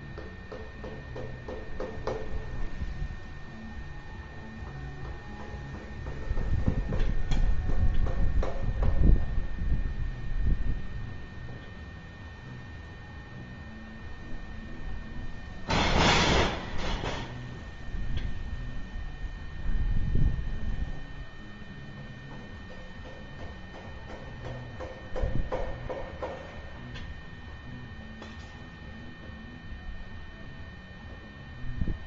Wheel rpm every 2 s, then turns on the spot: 0, 0, 0, 0, 0, 0, 0, 0, 0, 0, 0, 0, 0, 0, 0, 0.
none